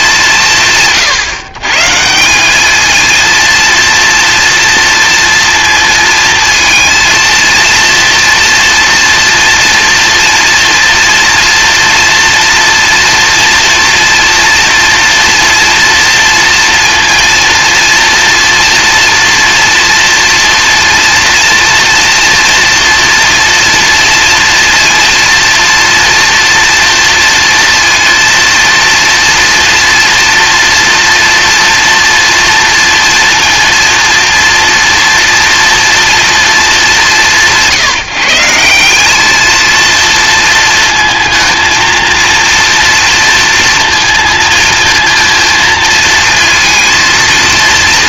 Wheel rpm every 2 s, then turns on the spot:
150, 200, 230, 220, 230, 240, 230, 230, 230, 230, 230, 240, 230, 230, 230, 230, 230, 230, 220, 170, 230, 230, 230, 230.
none